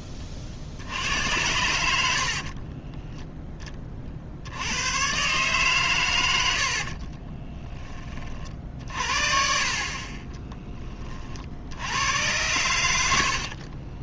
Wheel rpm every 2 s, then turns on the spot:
60, 30, 100, 60, 50, 20, 90.
2-4 6-8